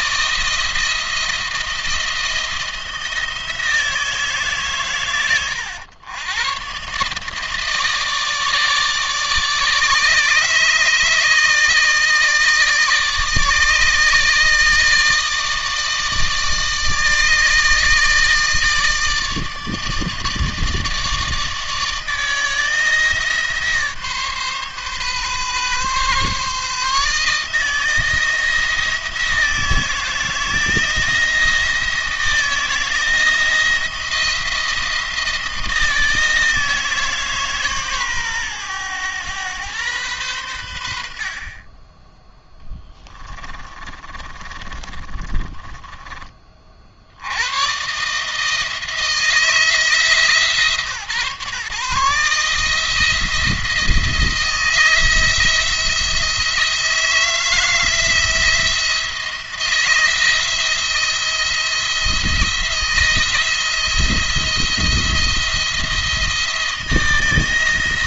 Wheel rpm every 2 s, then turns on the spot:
160, 160, 130, 130, 160, 150, 160, 160, 160, 150, 160, 160, 140, 140, 160, 160, 170, 170, 160, 120, 80, 10, 30, 40, 160, 150, 160, 170, 170, 170, 170, 170, 170, 170.
42-46